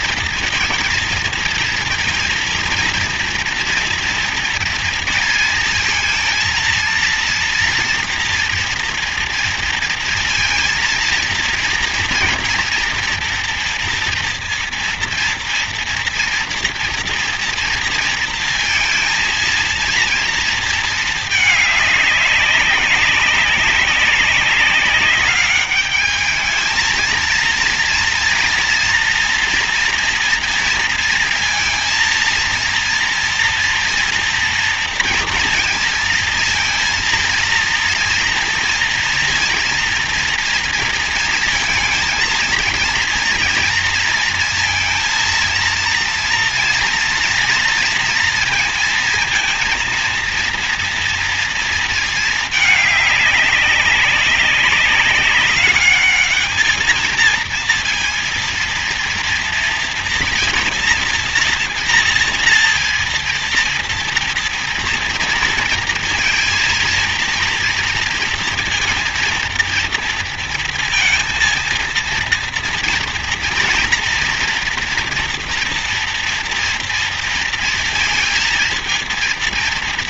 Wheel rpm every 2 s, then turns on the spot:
230, 230, 230, 230, 240, 230, 230, 230, 230, 230, 230, 200, 190, 220, 230, 230, 230, 230, 230, 230, 230, 230, 230, 230, 230, 230, 210, 200, 220, 230, 230, 230, 230, 230, 230, 230, 230, 240, 230, 230.
none